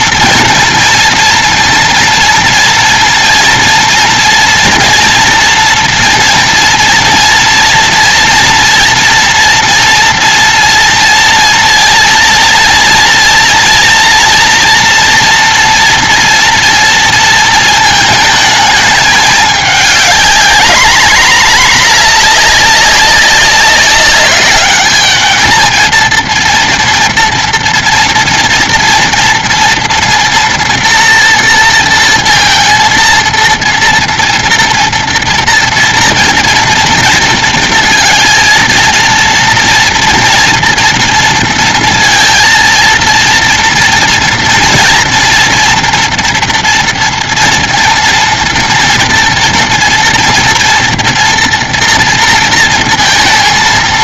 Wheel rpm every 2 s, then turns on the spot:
230, 230, 230, 230, 230, 230, 230, 240, 230, 220, 200, 210, 200, 220, 230, 230, 230, 230, 230, 230, 230, 230, 230, 240, 240, 230, 230.
none